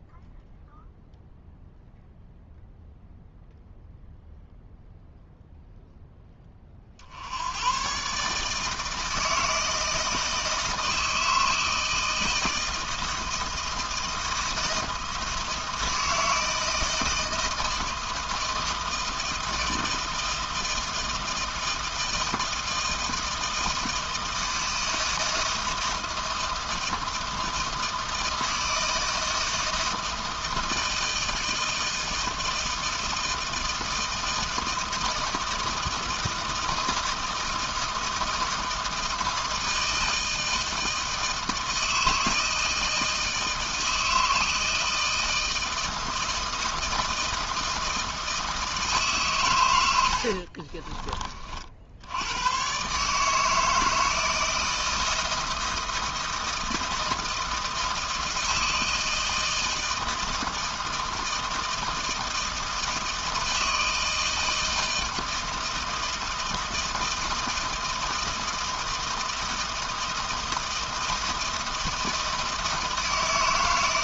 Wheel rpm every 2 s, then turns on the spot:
0, 0, 0, 30, 150, 160, 160, 160, 160, 160, 160, 160, 160, 160, 160, 160, 160, 160, 160, 160, 160, 160, 160, 160, 160, 30, 120, 160, 160, 160, 160, 160, 160, 160, 160, 160, 160.
50-52